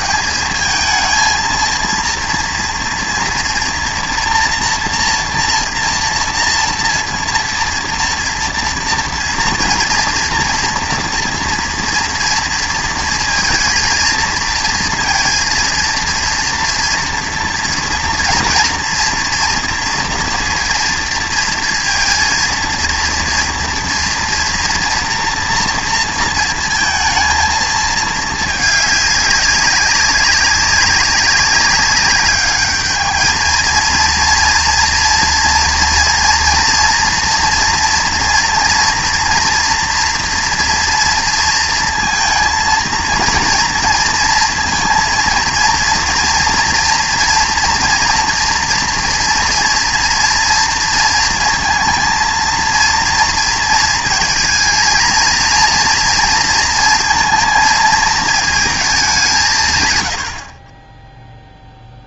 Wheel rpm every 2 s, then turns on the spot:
220, 230, 240, 230, 230, 230, 230, 230, 230, 230, 230, 230, 230, 220, 210, 200, 210, 230, 230, 240, 230, 230, 230, 230, 230, 230, 230, 230, 230, 220, 40.
none